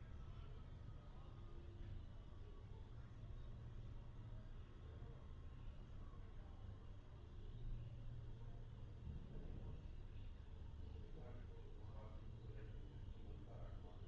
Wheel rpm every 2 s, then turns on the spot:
0, 0, 0, 0, 0, 0, 0.
none